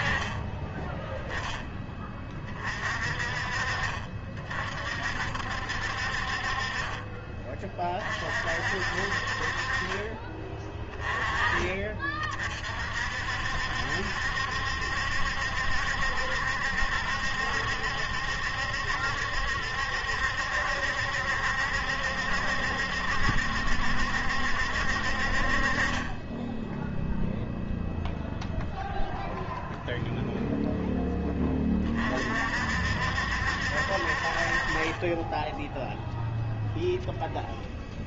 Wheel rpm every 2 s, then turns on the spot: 10, 40, 50, 30, 50, 20, 50, 70, 70, 70, 70, 70, 60, 0, 0, 0, 60, 30, 0.
none